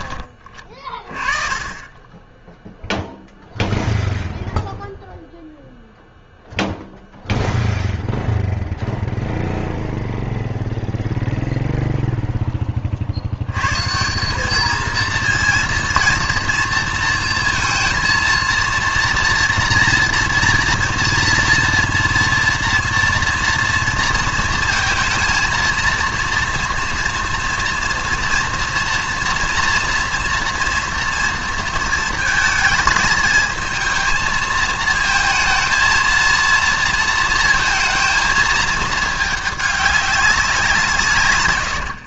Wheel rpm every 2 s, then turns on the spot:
30, 10, 0, 0, 0, 0, 10, 200, 230, 230, 230, 230, 230, 230, 230, 230, 220, 220, 230, 220, 190.
none